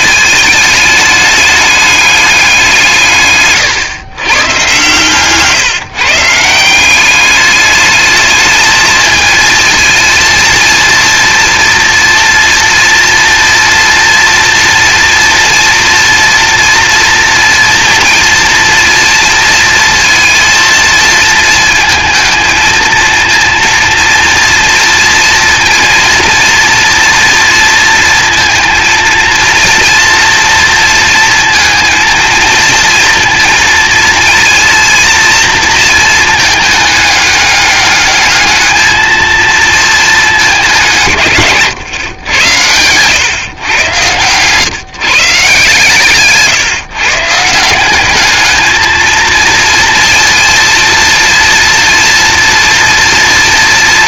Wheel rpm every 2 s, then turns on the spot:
220, 180, 120, 170, 220, 230, 230, 230, 240, 230, 230, 230, 230, 240, 230, 230, 230, 230, 220, 220, 180, 110, 130, 140, 220, 230, 230.
none